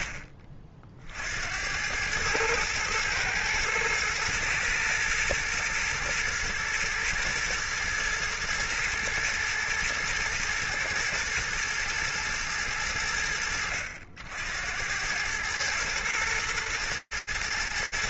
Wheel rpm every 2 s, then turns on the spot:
40, 110, 120, 120, 120, 120, 90, 90, 110.
none